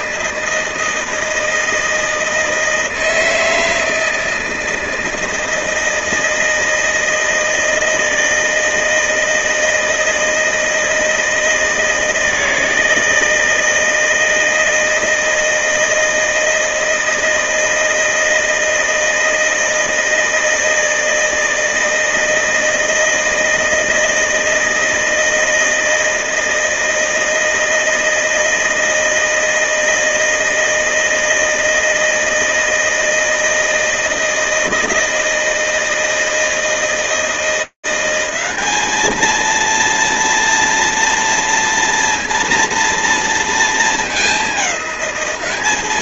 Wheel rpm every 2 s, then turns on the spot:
160, 160, 160, 160, 160, 160, 160, 160, 160, 160, 160, 160, 160, 160, 160, 160, 160, 160, 170, 220, 230, 230, 200.
none